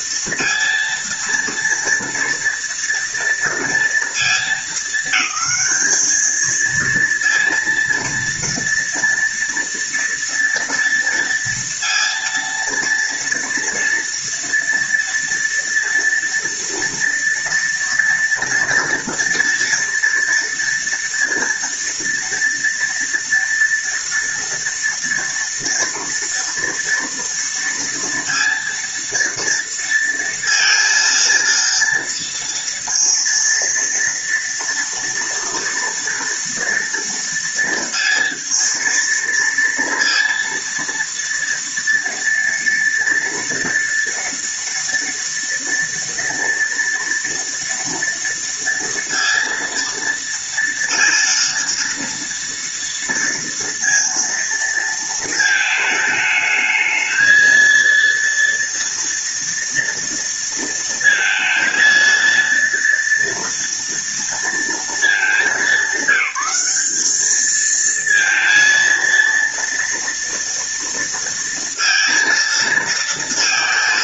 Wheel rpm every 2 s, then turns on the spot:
230, 230, 220, 230, 230, 230, 230, 230, 240, 230, 230, 230, 240, 230, 230, 230, 230, 230, 230, 230, 230, 230, 230, 230, 230, 230, 230, 230, 220, 230, 230, 230, 230, 200, 230, 230, 230.
none